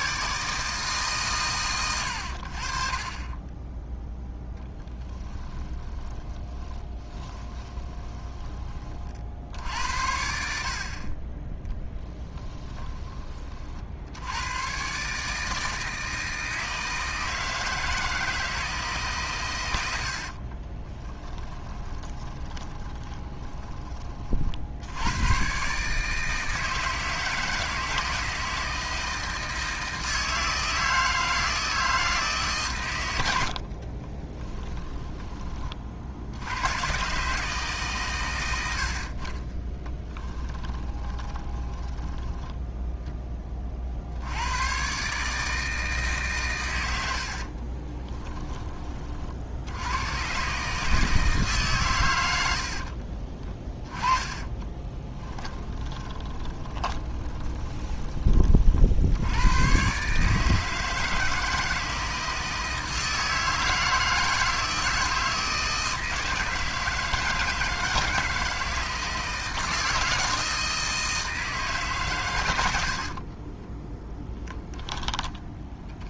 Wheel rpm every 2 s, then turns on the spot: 150, 30, 10, 20, 30, 40, 20, 130, 160, 150, 30, 10, 80, 160, 160, 160, 130, 20, 120, 60, 20, 10, 130, 90, 30, 150, 50, 20, 20, 60, 160, 160, 160, 160, 160, 160, 60, 20.
6-8 20-24 34-36 38-42 52-58 72-76